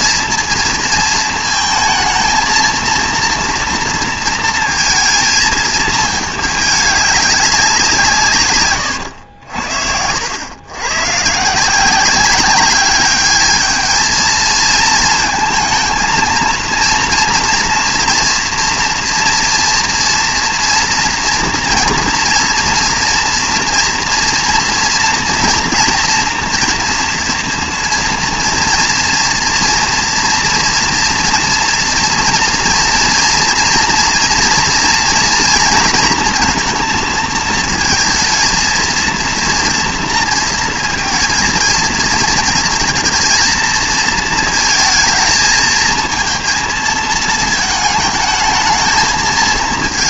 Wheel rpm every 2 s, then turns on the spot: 230, 220, 230, 210, 130, 110, 200, 220, 230, 230, 230, 230, 230, 230, 230, 240, 240, 230, 230, 230, 230, 230, 230, 230, 220.
none